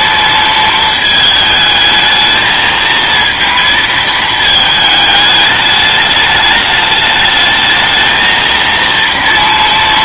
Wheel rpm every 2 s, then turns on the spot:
220, 220, 220, 210, 230.
none